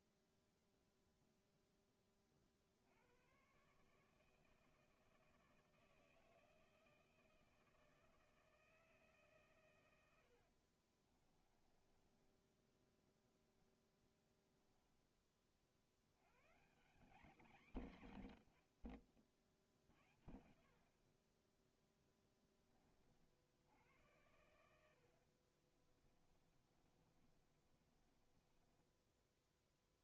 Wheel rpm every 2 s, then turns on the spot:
0, 40, 160, 160, 160, 40, 10, 10, 190, 70, 60, 20, 80, 30, 10.
10-14 26-30